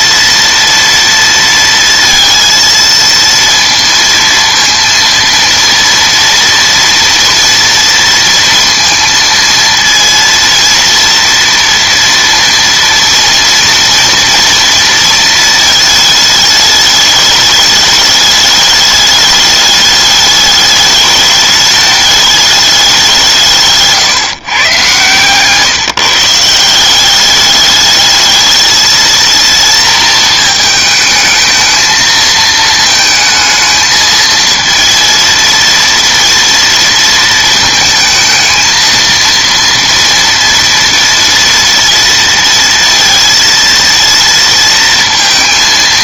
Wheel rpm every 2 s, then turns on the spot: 230, 230, 230, 230, 230, 230, 230, 230, 210, 210, 210, 210, 130, 170, 220, 220, 220, 230, 230, 230, 230, 230, 230.
none